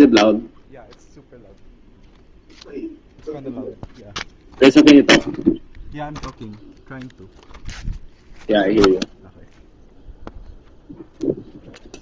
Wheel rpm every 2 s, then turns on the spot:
0, 0, 0, 0, 0, 0.
none